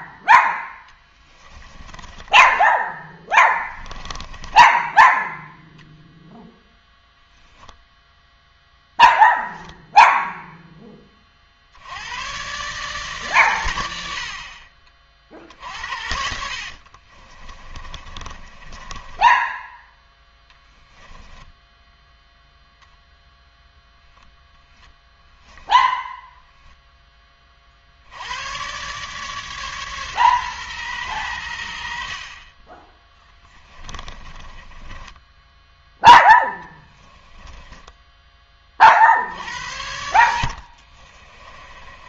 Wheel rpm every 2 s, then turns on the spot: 10, 10, 10, 10, 10, 0, 130, 50, 60, 30, 10, 0, 0, 10, 110, 130, 30, 20, 10, 20, 40.
4-6 16-22 34-38 40-42